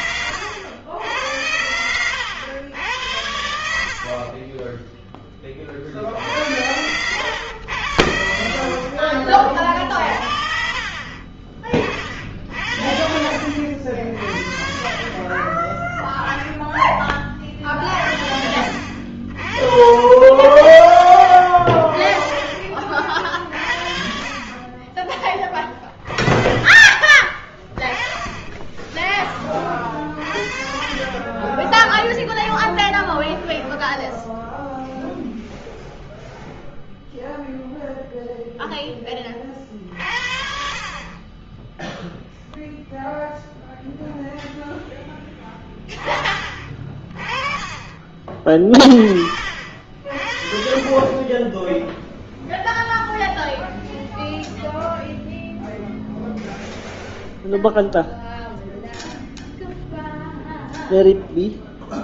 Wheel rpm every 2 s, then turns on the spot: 90, 90, 20, 90, 50, 40, 70, 30, 20, 60, 70, 40, 30, 20, 10, 40, 0, 0, 0, 10, 50, 0, 0, 30, 30, 30, 0, 0, 0, 0, 0.
none